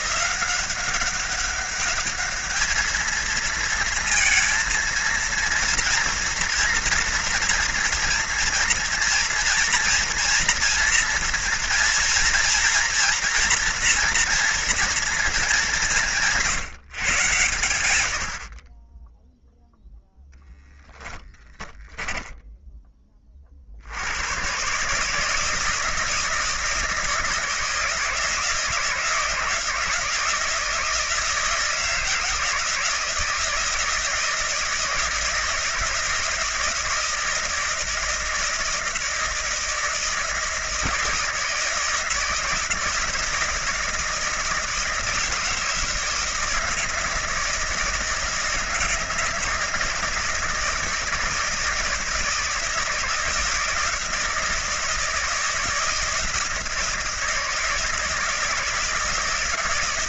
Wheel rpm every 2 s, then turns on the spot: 180, 220, 230, 230, 230, 230, 230, 230, 140, 20, 10, 10, 130, 160, 160, 160, 160, 160, 160, 160, 160, 160, 160, 160, 160, 160, 160, 160, 160, 160.
20-22